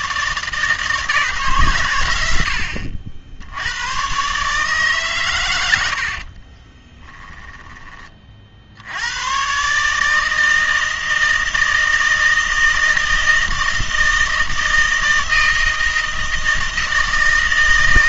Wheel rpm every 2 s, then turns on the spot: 150, 80, 140, 30, 70, 160, 160, 160, 160.
6-8